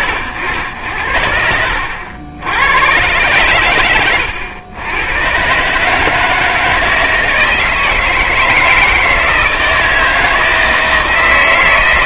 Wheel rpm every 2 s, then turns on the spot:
70, 100, 90, 160, 160, 160.
none